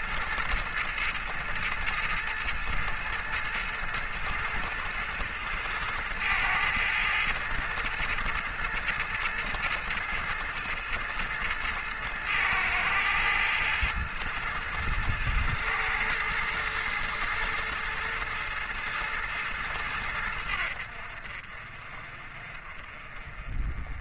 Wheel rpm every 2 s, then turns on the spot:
110, 110, 120, 110, 110, 110, 110, 110, 110, 110, 70, 40.
none